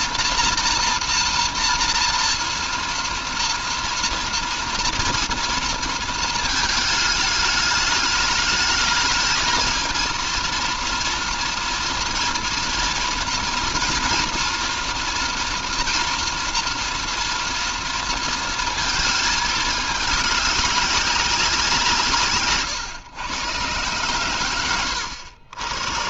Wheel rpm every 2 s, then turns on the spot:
230, 230, 230, 220, 220, 230, 240, 230, 240, 220, 200, 130, 90.
none